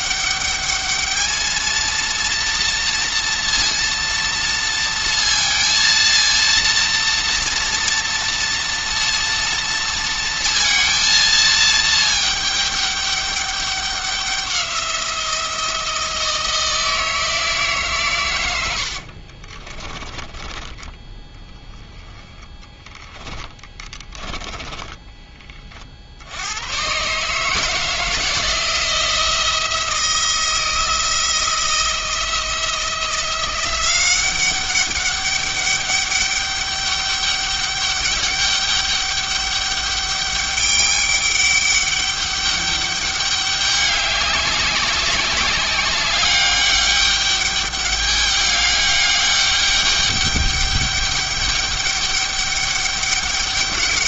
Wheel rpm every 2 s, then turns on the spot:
210, 230, 230, 230, 230, 230, 210, 180, 160, 70, 10, 10, 10, 120, 170, 170, 170, 200, 200, 200, 200, 200, 190, 200, 200, 200, 200.
22-26